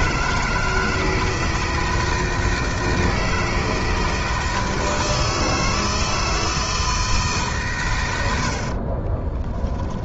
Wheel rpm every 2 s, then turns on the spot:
160, 160, 160, 160, 40.
8-10